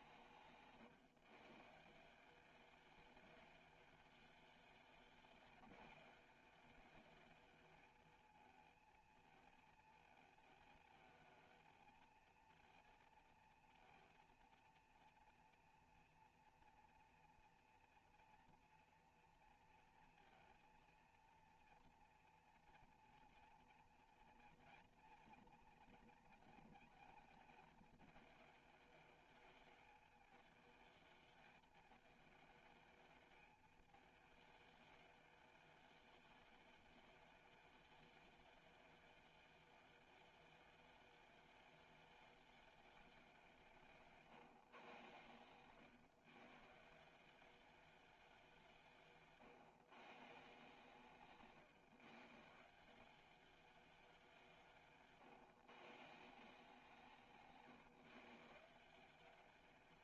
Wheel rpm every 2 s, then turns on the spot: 150, 200, 210, 220, 220, 220, 230, 230, 230, 240, 230, 230, 230, 220, 210, 220, 220, 210, 210, 210, 210, 210, 130, 150, 170, 150, 170, 170, 160, 170.
none